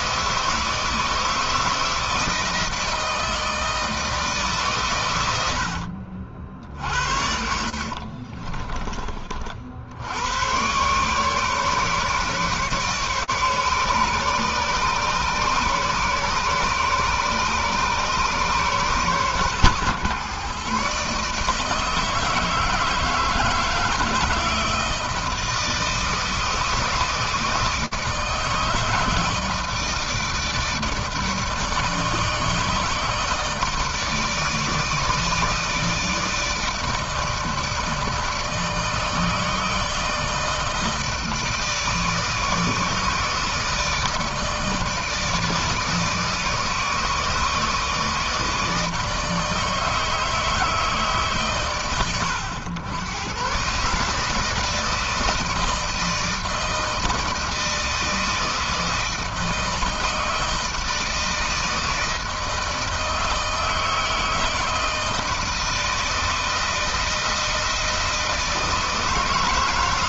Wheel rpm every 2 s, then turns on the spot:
160, 160, 120, 60, 40, 130, 140, 140, 140, 130, 140, 160, 160, 160, 160, 150, 160, 160, 150, 160, 160, 160, 160, 160, 160, 150, 100, 160, 160, 160, 160, 160, 160, 160, 160.
6-8